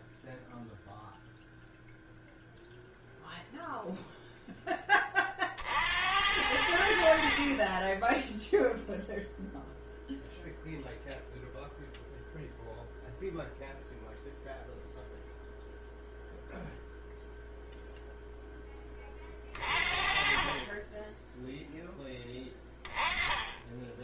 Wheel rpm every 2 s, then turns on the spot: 0, 0, 20, 60, 0, 0, 0, 0, 0, 20, 20, 10.
none